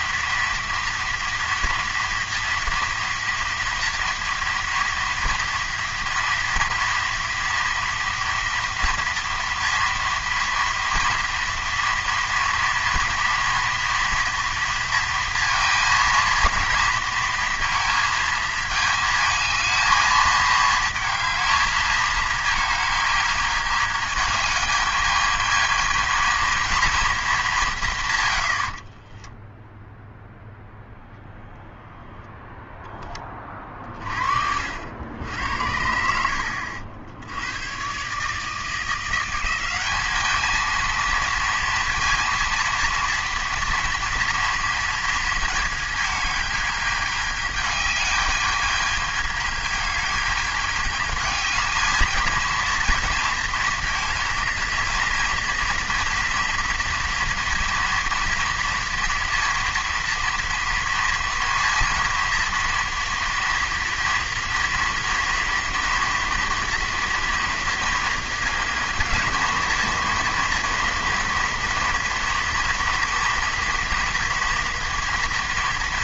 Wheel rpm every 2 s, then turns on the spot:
230, 230, 230, 230, 230, 230, 230, 230, 230, 220, 220, 220, 210, 230, 60, 0, 0, 70, 70, 160, 220, 230, 230, 210, 210, 220, 230, 230, 230, 230, 230, 230, 230, 230, 230, 230, 230, 230.
28-30